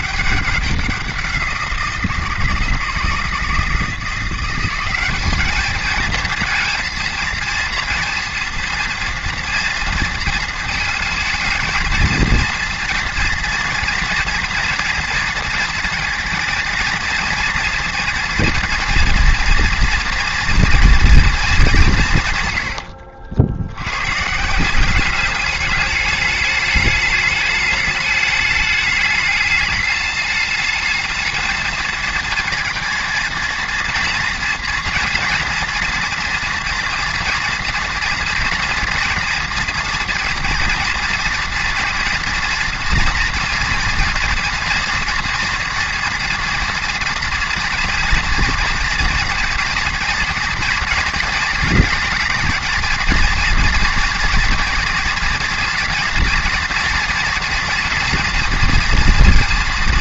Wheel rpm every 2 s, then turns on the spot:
190, 160, 190, 230, 230, 220, 230, 240, 230, 230, 230, 90, 200, 210, 210, 220, 220, 230, 230, 230, 230, 230, 240, 230, 230, 230, 230, 230, 230, 240.
22-24